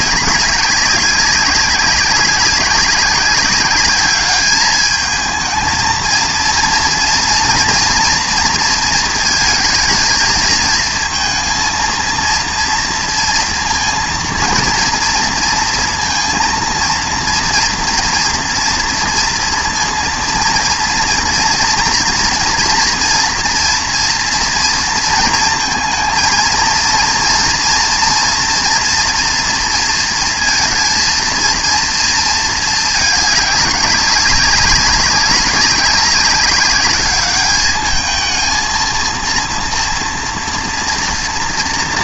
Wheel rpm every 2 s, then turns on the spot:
190, 200, 210, 230, 230, 230, 230, 230, 230, 230, 230, 240, 230, 230, 240, 230, 220, 190, 200, 230, 240.
none